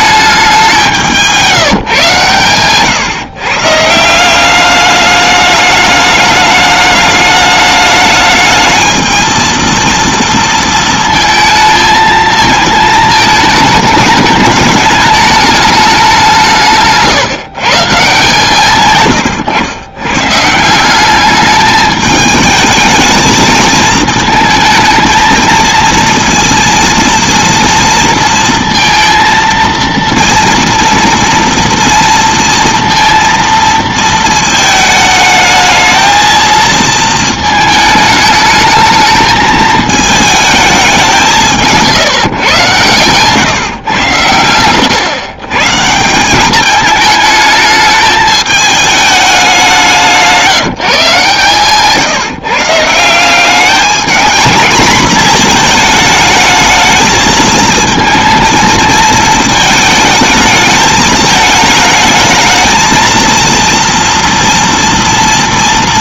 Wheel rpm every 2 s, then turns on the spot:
190, 130, 200, 210, 220, 230, 220, 210, 170, 130, 170, 220, 220, 230, 230, 230, 230, 220, 220, 220, 210, 130, 100, 210, 210, 170, 160, 230, 220, 220, 210, 220, 230.
none